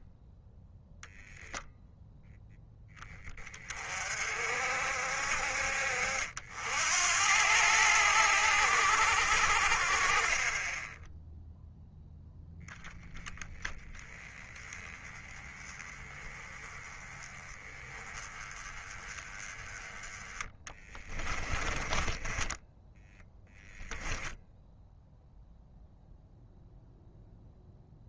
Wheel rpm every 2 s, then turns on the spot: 0, 10, 50, 80, 80, 10, 10, 20, 20, 20, 20, 10, 0, 0.
20-24